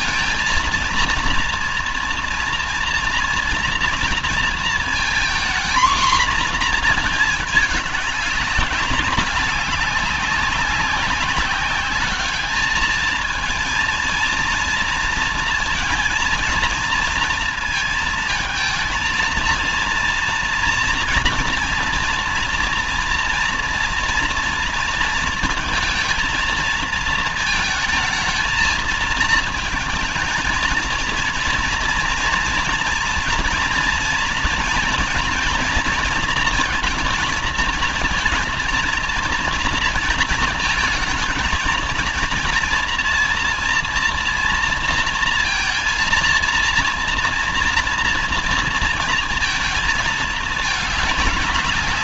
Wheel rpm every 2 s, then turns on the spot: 230, 230, 230, 230, 200, 190, 210, 230, 230, 220, 240, 230, 230, 220, 220, 230, 230, 230, 230, 230, 220, 230, 230, 230, 230, 220.
none